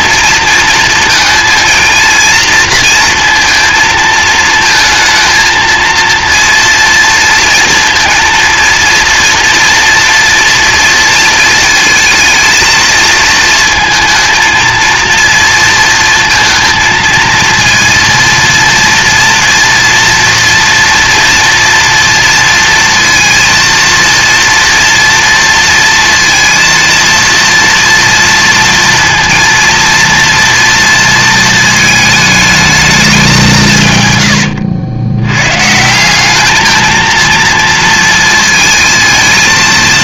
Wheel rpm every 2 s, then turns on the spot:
230, 230, 220, 230, 230, 230, 230, 220, 230, 230, 240, 230, 230, 230, 230, 230, 220, 90, 210, 220.
none